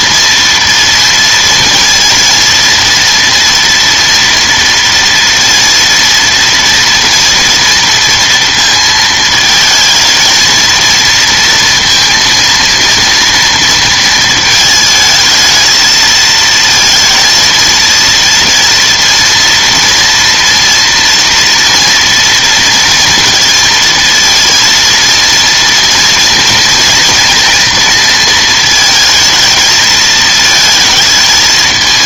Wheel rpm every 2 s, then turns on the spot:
230, 230, 230, 230, 230, 230, 230, 220, 230, 230, 230, 230, 230, 230, 220, 220.
none